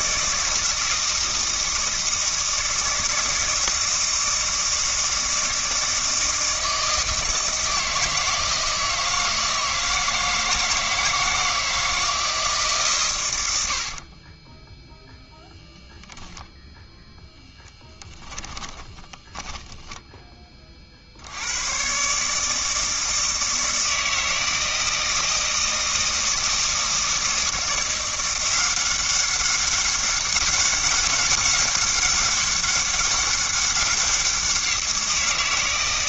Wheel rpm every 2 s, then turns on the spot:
160, 160, 160, 160, 160, 160, 130, 0, 0, 20, 40, 160, 160, 160, 180, 200, 200, 170.
18-20